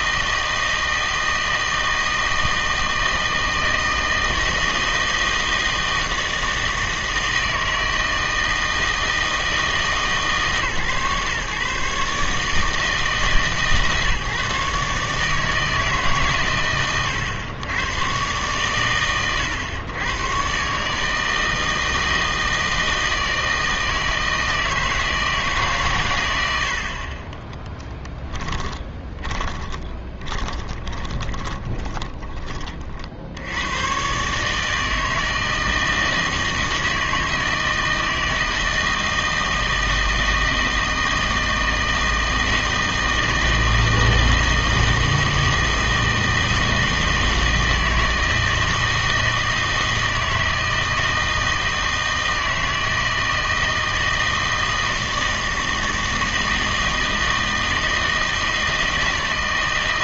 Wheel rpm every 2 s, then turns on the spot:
160, 160, 160, 160, 160, 140, 150, 140, 120, 120, 140, 160, 160, 60, 20, 30, 40, 160, 160, 160, 160, 160, 160, 160, 160, 160, 160, 160, 160, 160.
28-32